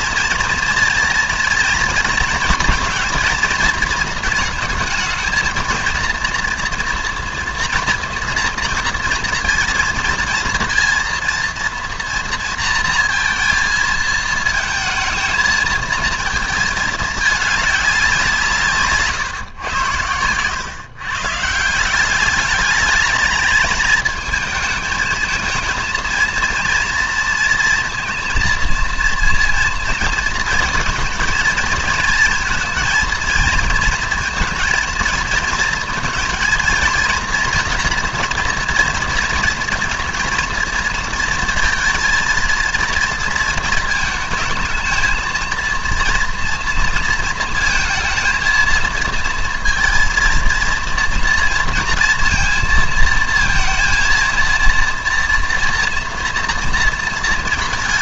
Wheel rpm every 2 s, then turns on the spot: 230, 230, 220, 230, 230, 230, 230, 220, 220, 150, 130, 200, 220, 230, 230, 230, 230, 230, 230, 240, 230, 230, 230, 240, 230, 230, 230, 230, 230.
none